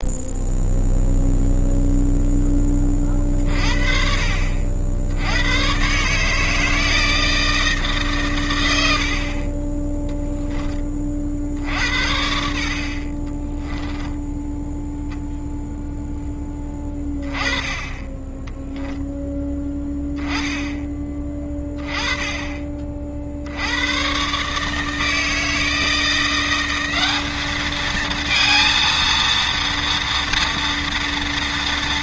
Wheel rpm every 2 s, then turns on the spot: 0, 30, 70, 160, 80, 20, 50, 0, 20, 0, 10, 30, 150, 190, 230, 230.
none